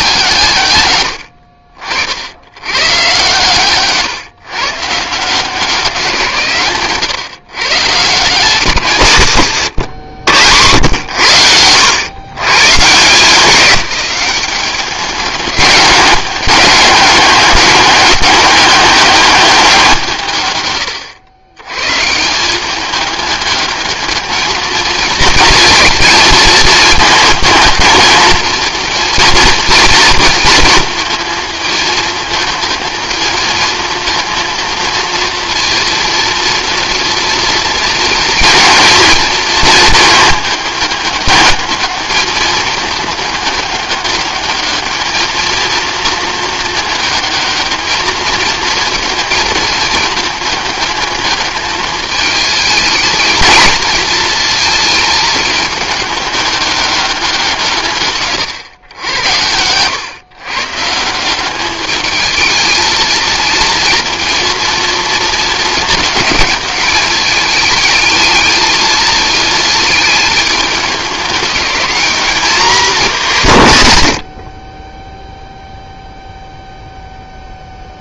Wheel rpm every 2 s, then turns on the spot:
130, 110, 140, 140, 160, 100, 130, 200, 200, 200, 120, 200, 220, 220, 230, 230, 220, 230, 230, 230, 210, 220, 220, 220, 220, 210, 220, 230, 200, 120, 140, 220, 230, 210, 220, 210, 190, 30, 0.
none